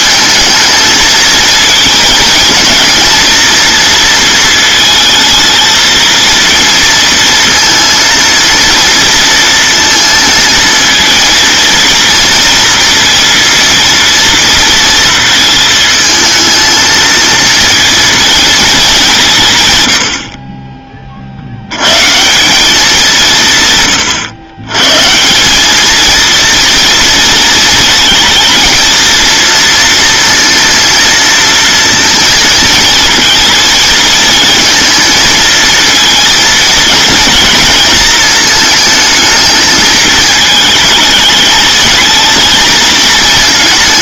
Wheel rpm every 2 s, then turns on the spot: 220, 220, 230, 230, 230, 220, 230, 230, 220, 210, 30, 190, 120, 230, 230, 230, 230, 230, 230, 220, 220, 230.
none